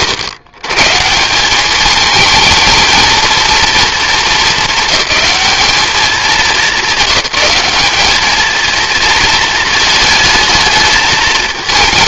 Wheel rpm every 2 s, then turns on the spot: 120, 220, 210, 190, 220, 220.
none